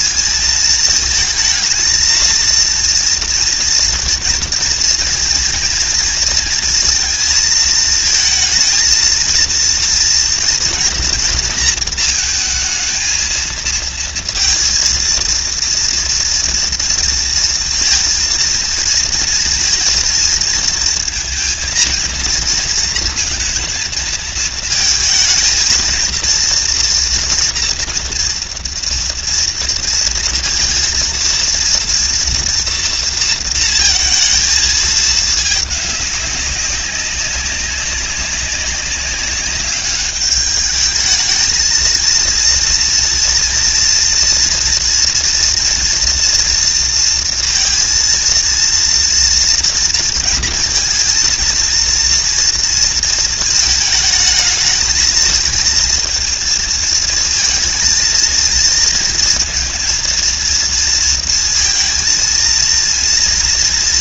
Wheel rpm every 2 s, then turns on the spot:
220, 240, 230, 220, 230, 230, 230, 230, 230, 230, 230, 220, 220, 230, 230, 230, 230, 210, 190, 200, 220, 230, 240, 230, 230, 230, 230, 230, 220, 230, 230, 230.
none